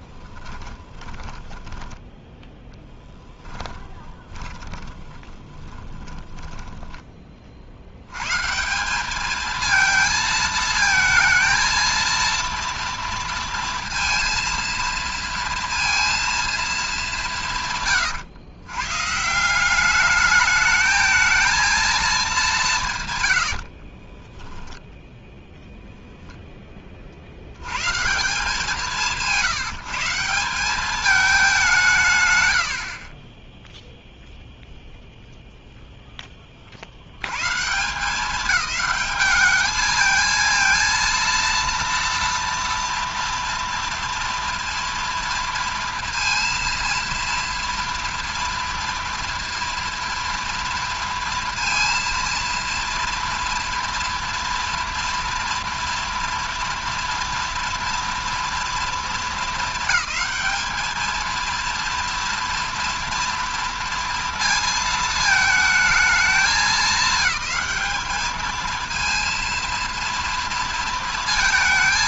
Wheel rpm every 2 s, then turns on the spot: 10, 20, 20, 70, 220, 230, 230, 230, 140, 190, 230, 50, 0, 150, 160, 150, 0, 0, 140, 210, 230, 230, 230, 230, 230, 230, 230, 240, 230, 210, 220, 230, 220, 220, 230, 230.
0-6 22-24